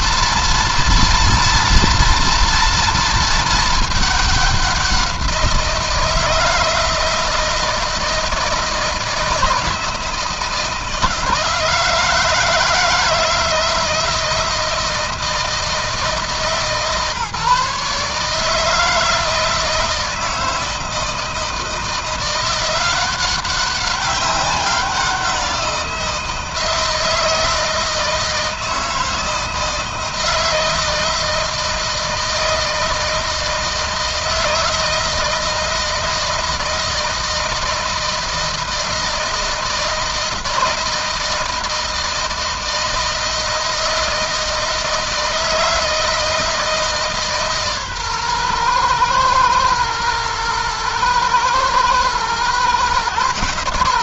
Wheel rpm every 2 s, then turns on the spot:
230, 230, 190, 160, 160, 160, 160, 160, 150, 160, 160, 180, 190, 160, 160, 160, 160, 160, 160, 160, 160, 160, 160, 160, 120, 120, 120.
none